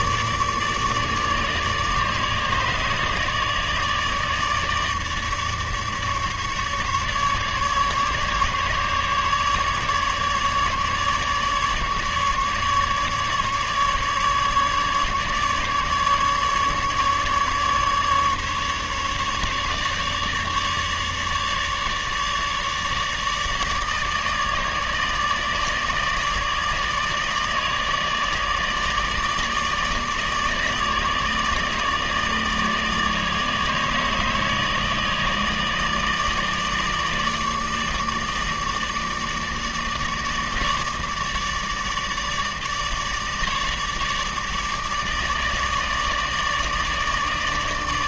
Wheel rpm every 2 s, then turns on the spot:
150, 150, 150, 150, 150, 150, 150, 150, 150, 150, 150, 150, 150, 160, 150, 150, 160, 160, 150, 160, 160, 150, 150, 150.
none